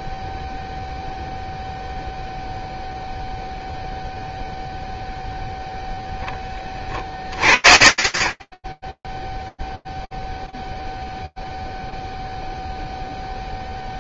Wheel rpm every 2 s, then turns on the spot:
0, 0, 0, 30, 0, 0, 0.
none